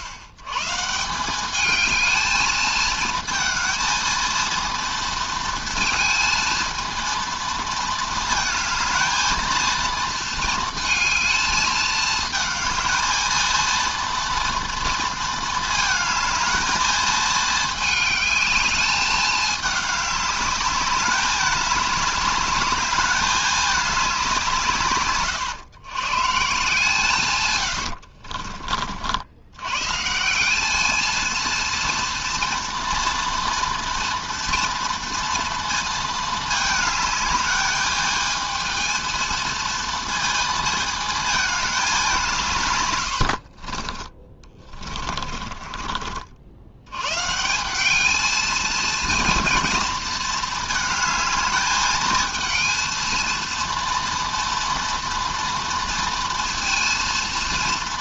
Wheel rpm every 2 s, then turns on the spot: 120, 220, 230, 230, 220, 230, 220, 230, 220, 210, 200, 210, 170, 150, 50, 200, 230, 230, 220, 220, 220, 140, 30, 70, 220, 220, 220, 230, 230.
44-46